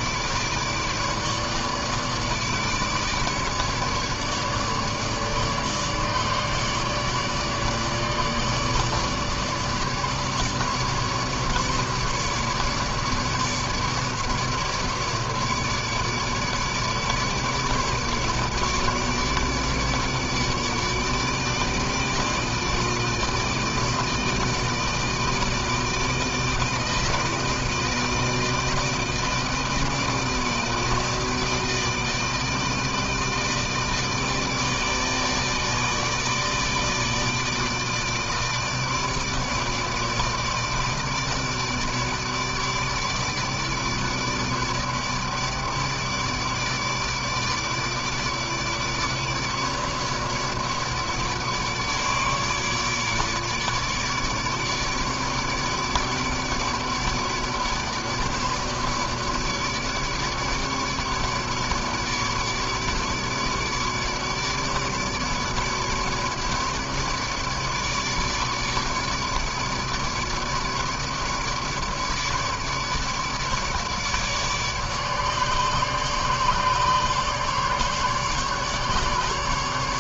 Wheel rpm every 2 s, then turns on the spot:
150, 150, 150, 150, 150, 150, 150, 150, 150, 150, 150, 160, 160, 160, 160, 160, 160, 160, 160, 160, 160, 150, 150, 150, 150, 150, 150, 150, 150, 150, 150, 150, 150, 150, 150, 150, 150, 150, 150, 150.
none